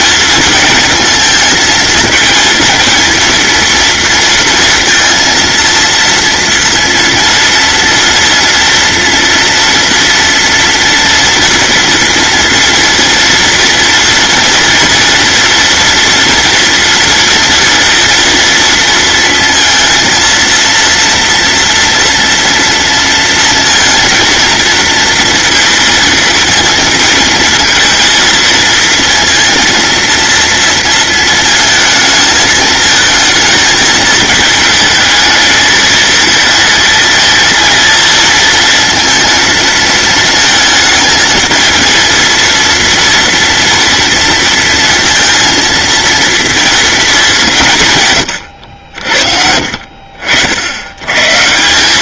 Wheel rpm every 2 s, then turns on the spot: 220, 230, 230, 230, 230, 230, 230, 240, 230, 230, 230, 230, 230, 220, 230, 230, 220, 220, 230, 230, 220, 230, 230, 200, 60, 120.
none